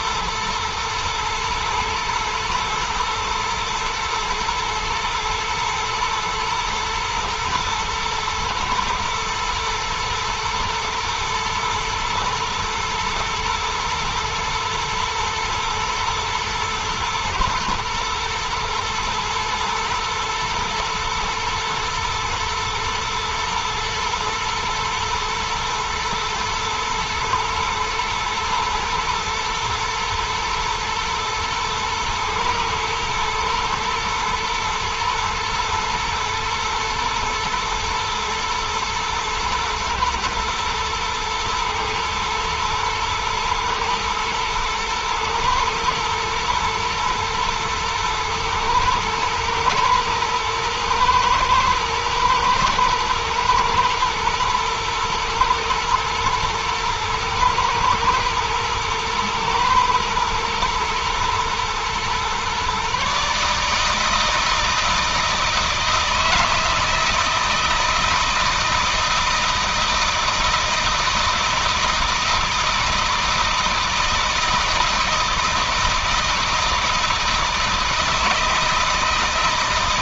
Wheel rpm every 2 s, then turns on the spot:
110, 110, 110, 120, 110, 110, 120, 120, 120, 120, 110, 110, 110, 110, 110, 120, 110, 120, 120, 110, 110, 110, 110, 120, 110, 120, 120, 120, 120, 110, 110, 130, 160, 160, 160, 160, 160, 160, 160, 160.
none